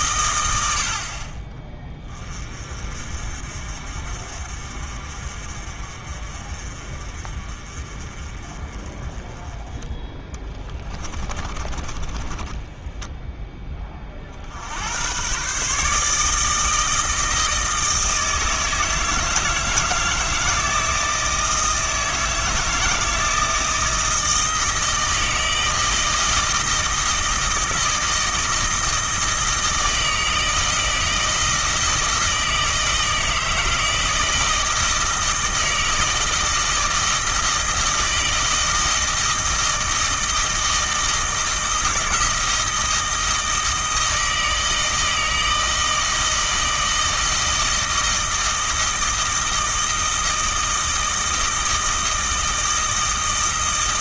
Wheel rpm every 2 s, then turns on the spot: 70, 40, 50, 40, 30, 20, 10, 90, 160, 160, 160, 160, 160, 160, 160, 160, 160, 160, 160, 160, 160, 160, 160, 160, 160, 160, 160.
10-14